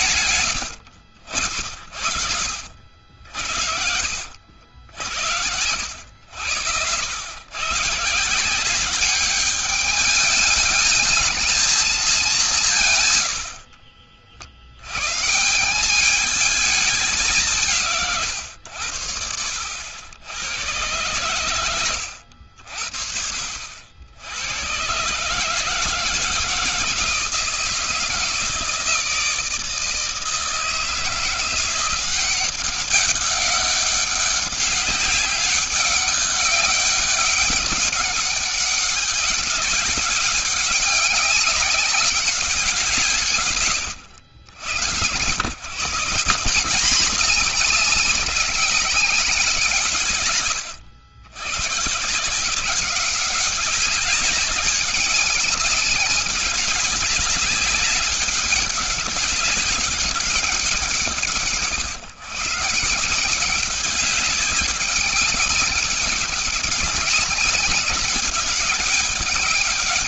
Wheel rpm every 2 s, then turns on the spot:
110, 60, 70, 80, 170, 210, 190, 70, 210, 120, 90, 70, 100, 160, 160, 160, 190, 190, 200, 190, 200, 180, 90, 180, 200, 130, 170, 190, 200, 190, 190, 130, 190, 190, 200.
0-2